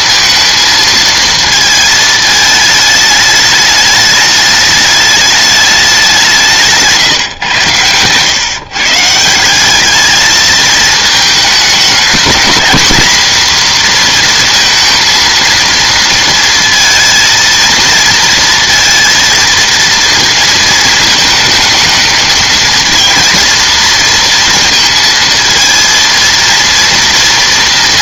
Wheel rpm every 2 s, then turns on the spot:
230, 220, 210, 160, 140, 220, 240, 230, 230, 230, 220, 220, 230, 230.
6-8